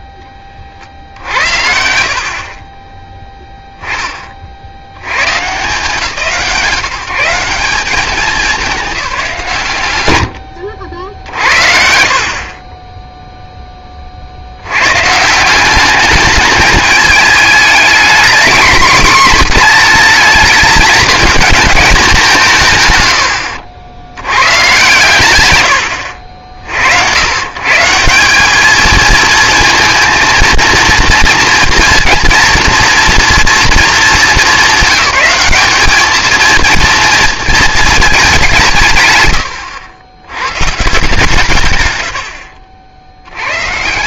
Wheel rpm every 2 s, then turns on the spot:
30, 40, 60, 170, 200, 70, 20, 90, 210, 230, 210, 170, 110, 70, 210, 230, 230, 200, 230, 160, 130, 30.
12-14